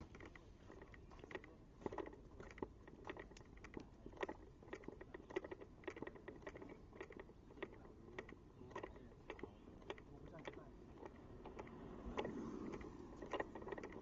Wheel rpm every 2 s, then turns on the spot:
0, 0, 0, 0, 0, 0, 0.
none